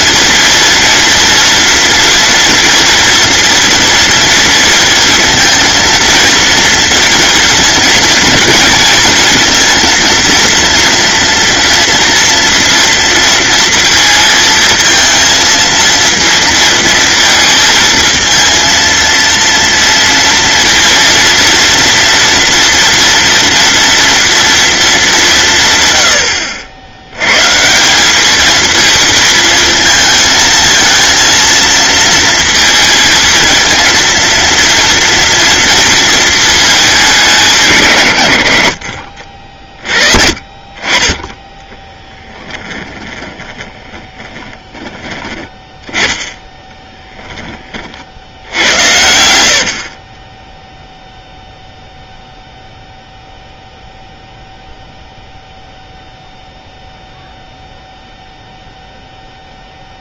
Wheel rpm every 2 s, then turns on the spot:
230, 240, 230, 230, 230, 230, 230, 230, 230, 230, 230, 230, 220, 90, 220, 230, 230, 230, 220, 70, 30, 20, 30, 10, 80, 0, 0, 0, 0, 0.
42-44 46-48